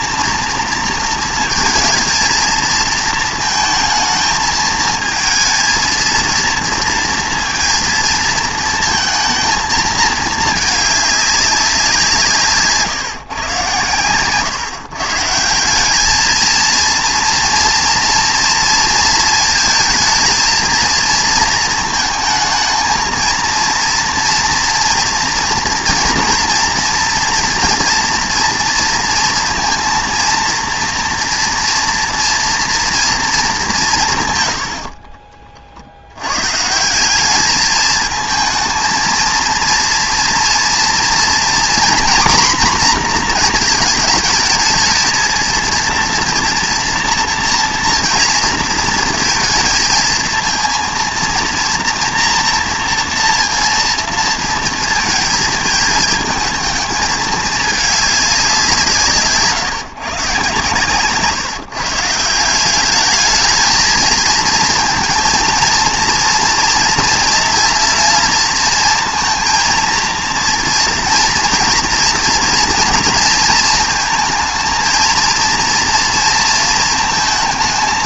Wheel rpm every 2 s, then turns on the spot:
230, 220, 220, 230, 220, 210, 140, 150, 230, 230, 230, 220, 230, 230, 230, 230, 230, 70, 160, 220, 230, 240, 220, 230, 230, 230, 230, 230, 220, 170, 130, 190, 220, 230, 230, 230, 230, 230, 230.
34-36